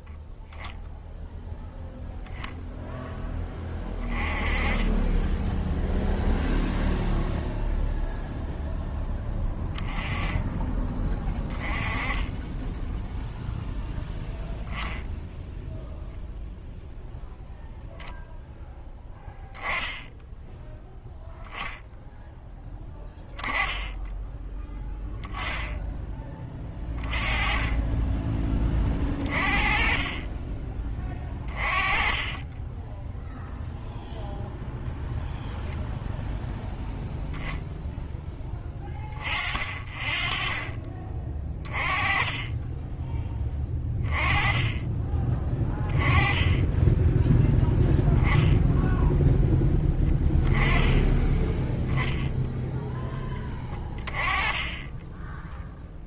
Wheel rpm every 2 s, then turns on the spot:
0, 0, 20, 0, 0, 20, 10, 0, 0, 0, 10, 10, 10, 20, 20, 20, 10, 0, 0, 30, 20, 10, 20, 10, 0, 10, 0, 20.
22-24 32-34 42-44 46-48